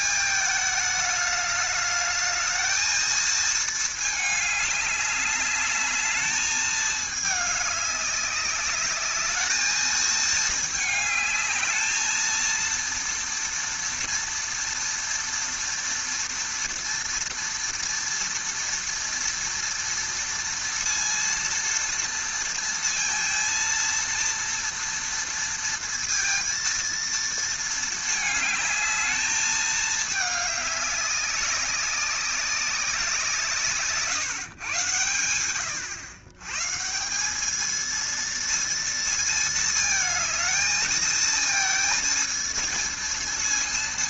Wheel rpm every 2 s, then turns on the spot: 220, 220, 210, 220, 200, 220, 230, 240, 230, 230, 230, 230, 230, 230, 220, 200, 190, 140, 130, 230, 220, 230.
none